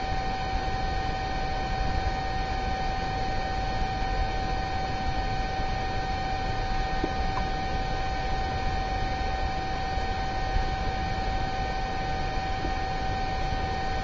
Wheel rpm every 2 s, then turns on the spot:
0, 0, 0, 0, 0, 0, 0.
none